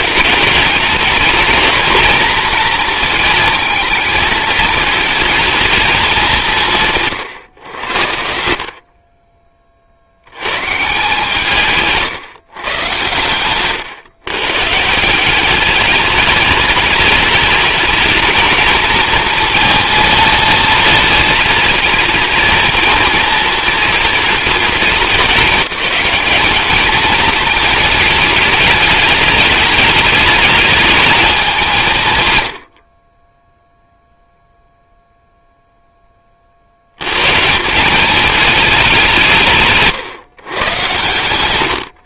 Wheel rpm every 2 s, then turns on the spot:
210, 230, 220, 170, 50, 150, 120, 160, 210, 230, 230, 220, 210, 220, 210, 220, 40, 0, 80, 190, 120.
8-10